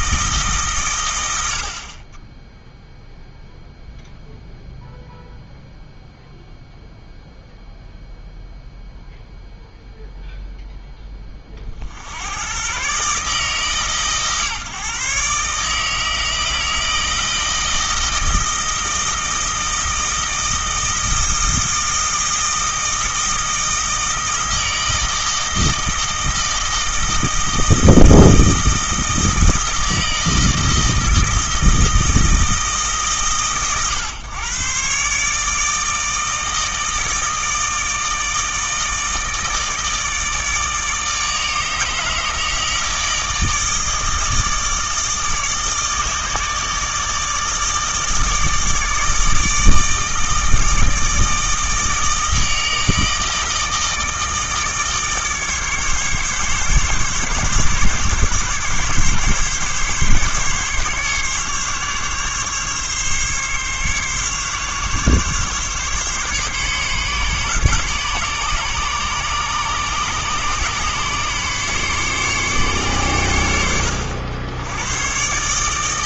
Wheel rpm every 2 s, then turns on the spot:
120, 0, 0, 0, 0, 10, 140, 140, 160, 160, 160, 160, 160, 160, 160, 160, 140, 130, 160, 160, 160, 160, 160, 150, 160, 160, 160, 150, 140, 140, 140, 140, 140, 140, 140, 140, 120, 120.
none